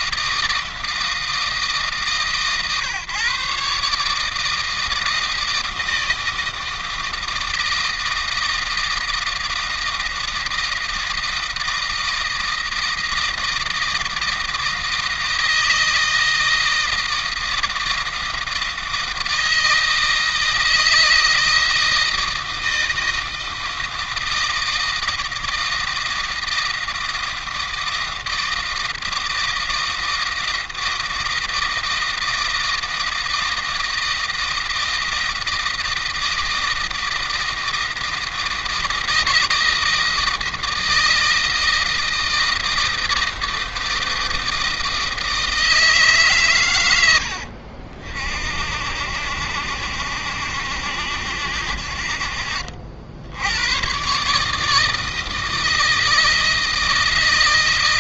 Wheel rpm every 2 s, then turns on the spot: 160, 130, 160, 160, 160, 160, 160, 160, 160, 160, 160, 160, 160, 160, 160, 160, 160, 160, 160, 160, 160, 160, 160, 100, 80, 90, 60, 150, 160.
46-48